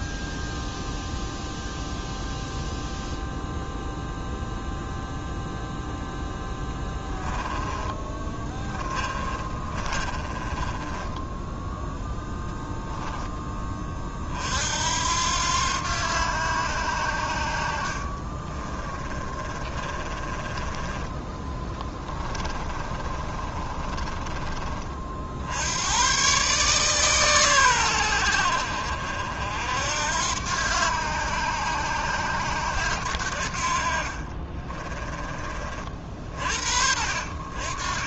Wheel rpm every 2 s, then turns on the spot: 0, 0, 0, 10, 20, 10, 10, 70, 80, 20, 10, 30, 40, 140, 60, 90, 80, 30, 50.
6-12 18-24 34-36